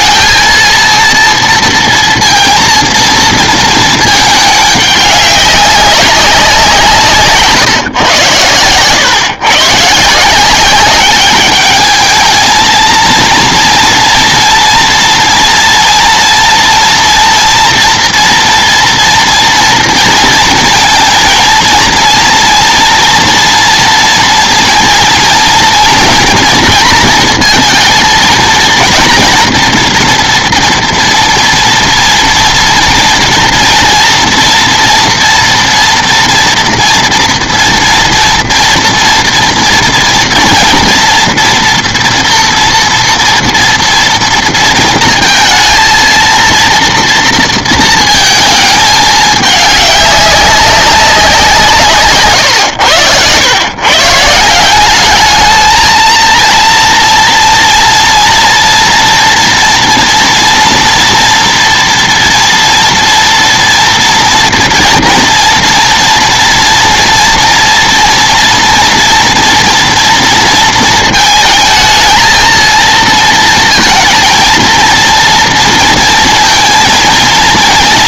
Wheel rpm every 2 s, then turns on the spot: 230, 230, 210, 170, 110, 190, 230, 230, 230, 230, 230, 230, 230, 230, 230, 230, 240, 230, 230, 240, 240, 230, 230, 230, 220, 200, 120, 180, 230, 240, 230, 240, 230, 230, 230, 230, 230, 230, 230.
52-54